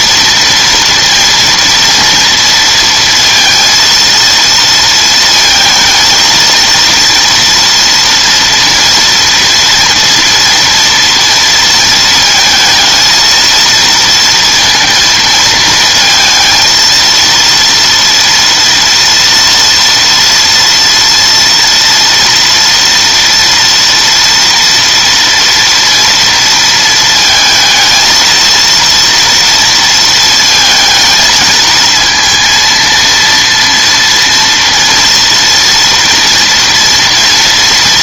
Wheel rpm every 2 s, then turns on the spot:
230, 230, 230, 230, 240, 230, 230, 230, 230, 230, 230, 230, 230, 230, 230, 220, 230, 230, 240.
none